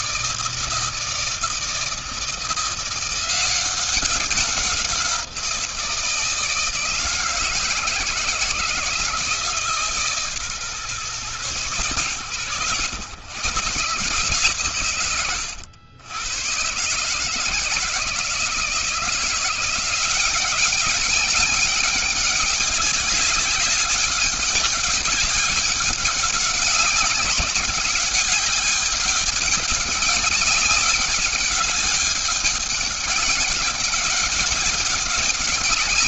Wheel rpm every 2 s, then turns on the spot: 160, 170, 180, 160, 160, 130, 100, 140, 130, 160, 190, 200, 200, 190, 200, 200, 200, 200.
none